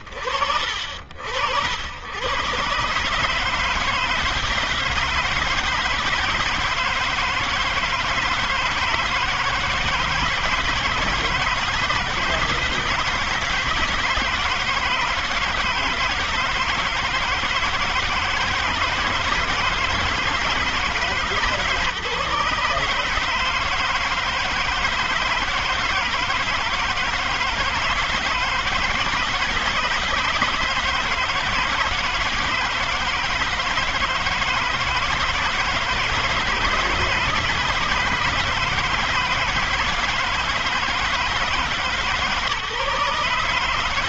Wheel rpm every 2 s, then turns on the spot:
70, 150, 160, 160, 160, 170, 160, 160, 160, 160, 150, 160, 160, 160, 160, 160, 170, 160, 160, 150, 150, 150.
none